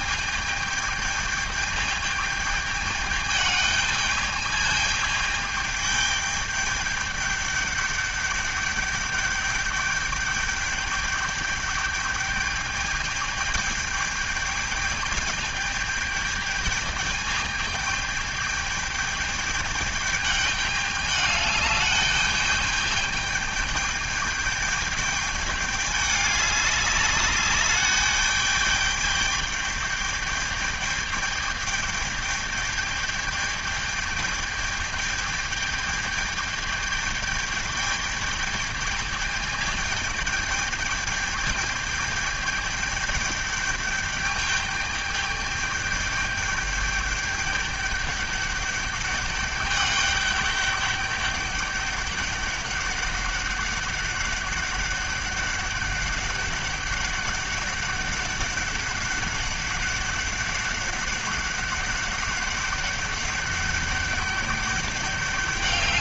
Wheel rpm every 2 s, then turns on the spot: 210, 210, 210, 210, 200, 210, 210, 210, 210, 210, 210, 210, 210, 200, 210, 210, 210, 210, 210, 210, 210, 210, 210, 210, 200, 200, 200, 200, 200, 200, 200, 200, 200.
none